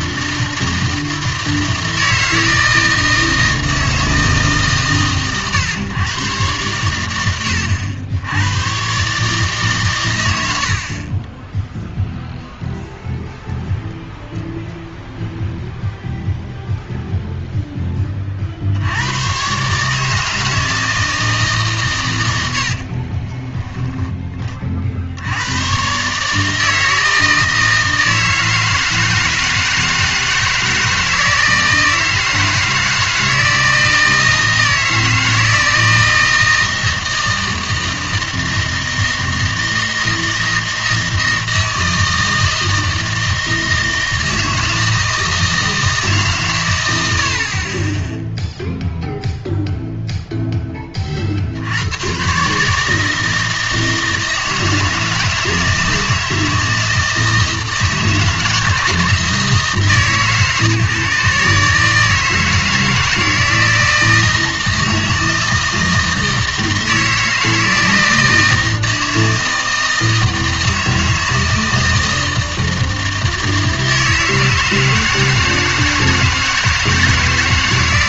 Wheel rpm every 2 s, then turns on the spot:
160, 160, 150, 110, 110, 60, 0, 0, 0, 70, 160, 80, 40, 160, 160, 160, 160, 160, 160, 160, 160, 160, 160, 110, 0, 10, 150, 160, 160, 170, 140, 160, 160, 160, 160, 160, 160, 160, 160.
none